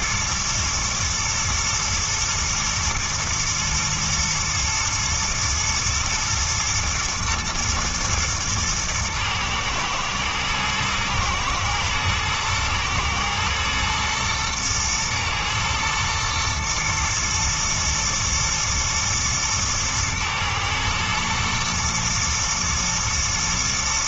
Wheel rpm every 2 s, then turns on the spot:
120, 110, 110, 120, 110, 110, 110, 110, 120, 120, 120, 120.
none